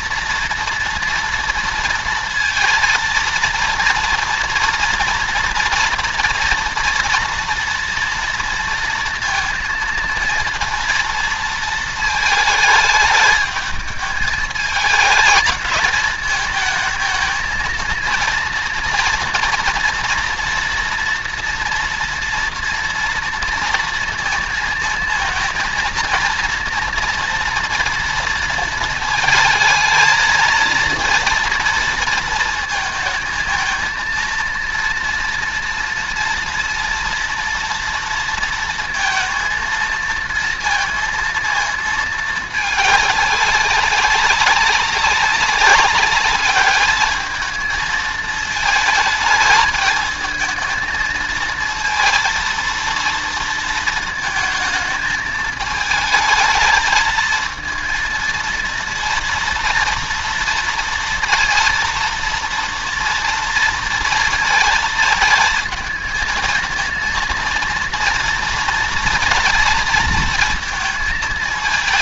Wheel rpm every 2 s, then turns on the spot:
230, 230, 230, 240, 230, 230, 220, 220, 220, 230, 230, 230, 230, 230, 220, 230, 230, 230, 230, 230, 230, 210, 190, 210, 220, 230, 230, 220, 220, 230, 230, 230, 220, 230, 230, 220.
none